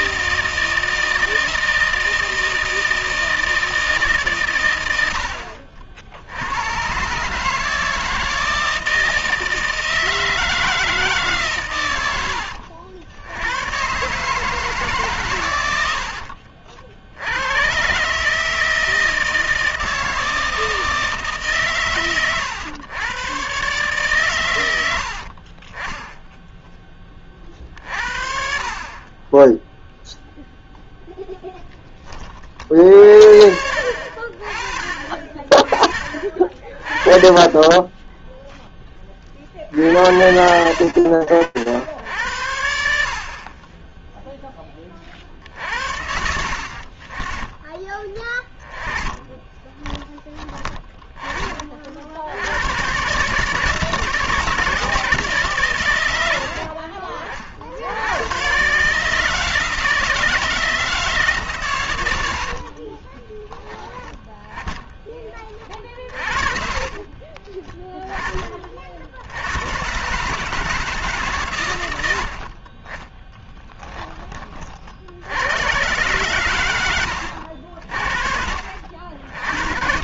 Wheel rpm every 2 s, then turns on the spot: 160, 160, 110, 100, 160, 160, 80, 150, 60, 160, 160, 110, 100, 10, 40, 0, 30, 40, 40, 0, 70, 70, 30, 40, 20, 20, 140, 150, 50, 160, 150, 10, 30, 30, 80, 130, 10, 90, 80, 100.
12-14 16-18 48-50 62-68 72-74